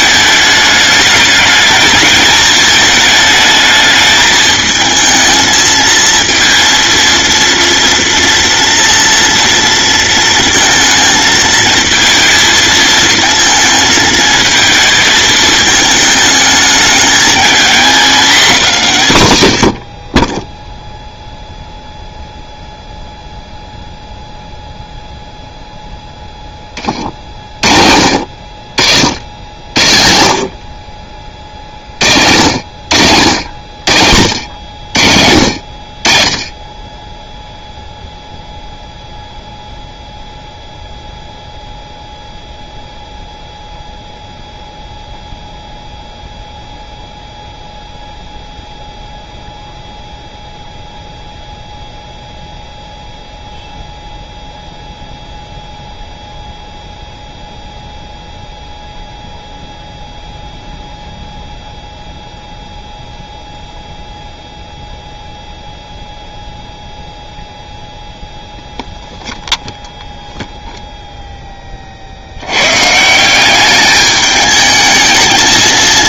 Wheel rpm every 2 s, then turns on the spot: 210, 220, 220, 230, 230, 220, 220, 220, 220, 190, 0, 0, 0, 30, 70, 40, 80, 80, 20, 0, 0, 0, 0, 0, 0, 0, 0, 0, 0, 0, 0, 0, 0, 0, 0, 0, 140, 220.
none